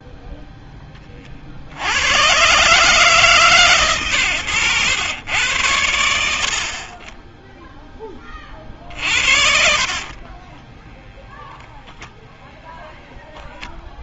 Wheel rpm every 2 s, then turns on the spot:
10, 120, 100, 40, 50, 20, 0.
8-12